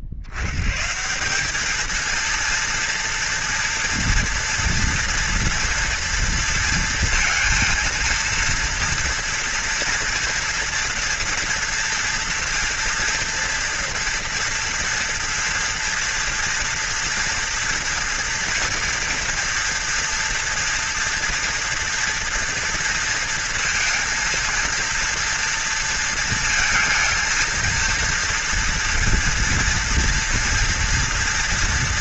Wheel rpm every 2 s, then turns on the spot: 70, 230, 240, 230, 230, 230, 230, 230, 230, 230, 230, 240, 230, 220, 230, 230.
none